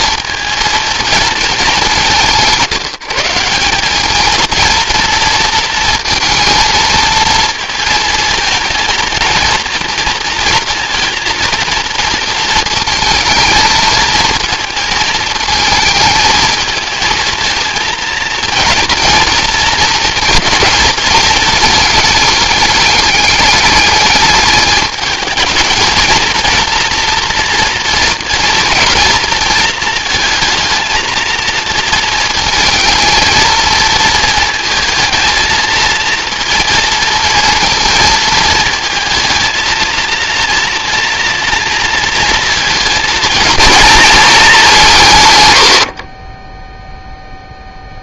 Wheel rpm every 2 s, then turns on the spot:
230, 170, 230, 230, 220, 230, 220, 220, 220, 230, 230, 210, 210, 230, 220, 220, 220, 220, 230, 220, 230, 220, 180, 0.
none